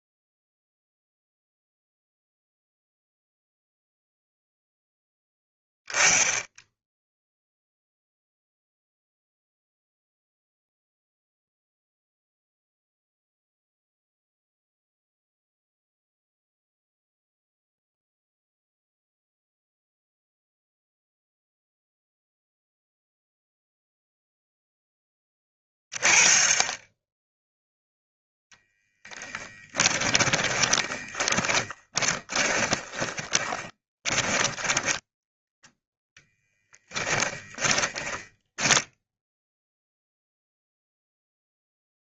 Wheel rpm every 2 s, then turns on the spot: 0, 0, 0, 10, 0, 0, 0, 0, 0, 0, 0, 0, 10, 20, 10, 10, 20, 20, 20, 10, 0.
30-34 36-40